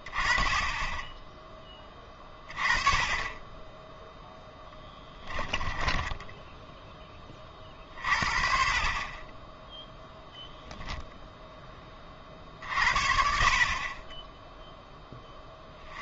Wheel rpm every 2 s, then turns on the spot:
20, 20, 10, 0, 30, 0, 40, 10.
4-6